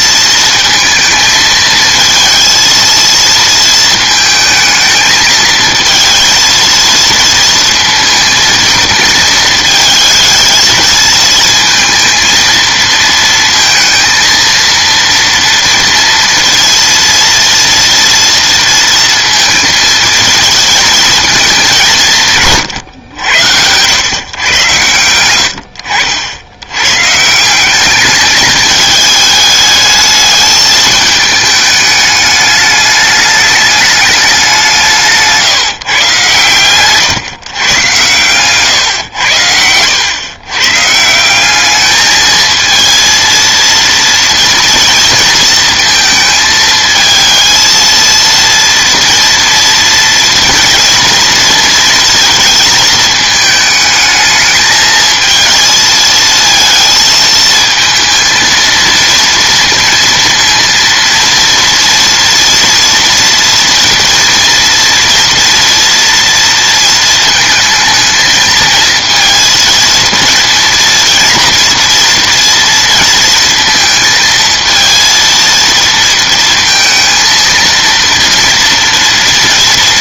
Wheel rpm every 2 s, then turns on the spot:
220, 230, 220, 230, 220, 230, 230, 230, 230, 230, 230, 110, 110, 120, 210, 220, 210, 170, 120, 130, 140, 220, 230, 220, 230, 230, 220, 220, 220, 230, 230, 230, 230, 230, 220, 230, 230, 230, 230, 230.
24-26 34-36